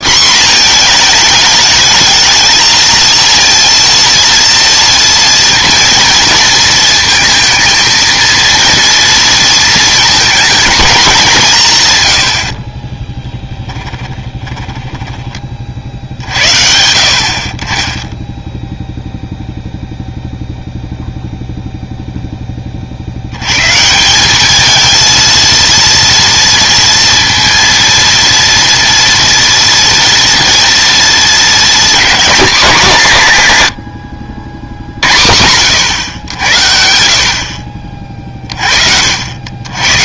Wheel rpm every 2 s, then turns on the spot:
230, 230, 230, 230, 230, 210, 40, 20, 60, 10, 0, 30, 210, 230, 230, 230, 220, 80, 80, 40.
12-16